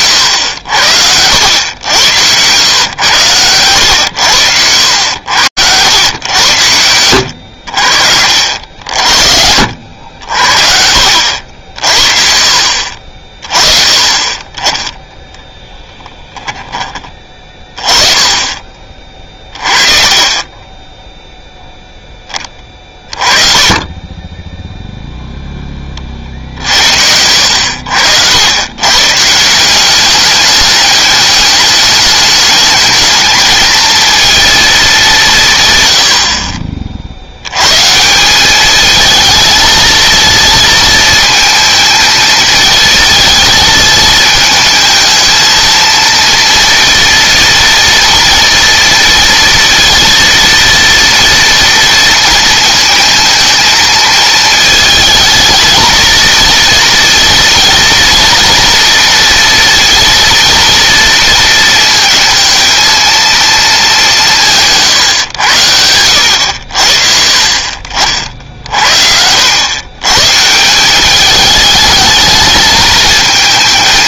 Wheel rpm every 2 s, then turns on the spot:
80, 110, 90, 100, 40, 60, 50, 10, 20, 30, 10, 30, 0, 60, 130, 200, 210, 210, 50, 220, 220, 220, 220, 230, 240, 230, 230, 220, 230, 230, 230, 230, 140, 70, 60, 180, 220.
6-8